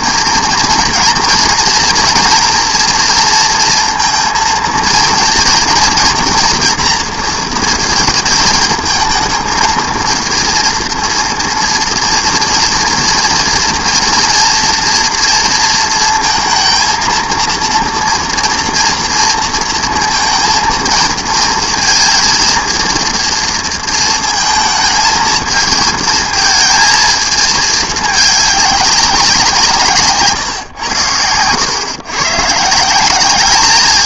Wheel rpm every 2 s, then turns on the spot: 230, 240, 230, 230, 220, 230, 230, 230, 230, 230, 230, 230, 220, 220, 200, 130, 160.
none